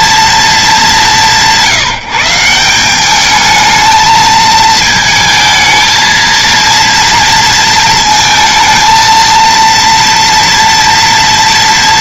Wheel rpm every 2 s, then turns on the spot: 210, 180, 220, 230, 230, 230.
none